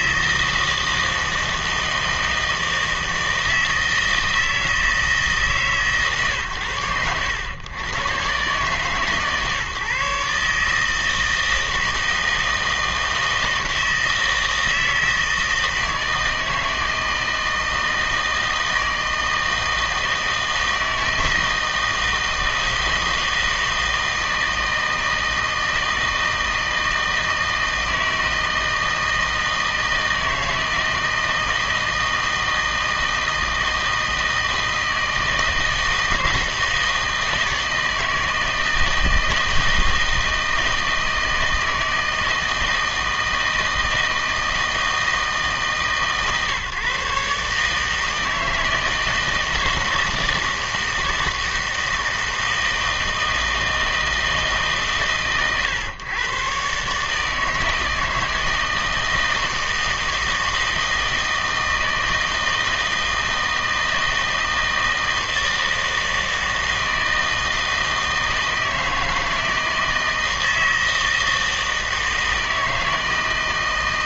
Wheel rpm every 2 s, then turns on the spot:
160, 160, 160, 110, 140, 160, 160, 160, 160, 160, 160, 160, 160, 160, 160, 160, 160, 160, 160, 160, 160, 160, 160, 140, 160, 160, 160, 140, 130, 160, 160, 160, 160, 160, 160, 160, 160.
none